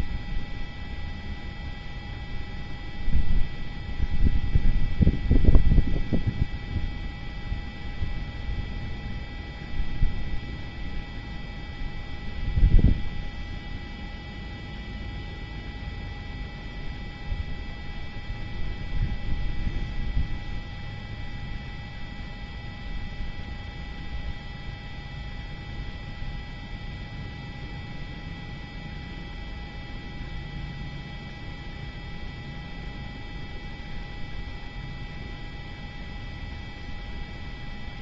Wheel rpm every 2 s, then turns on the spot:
0, 0, 0, 0, 0, 0, 0, 0, 0, 0, 0, 0, 0, 0, 0, 0, 0, 0, 0.
none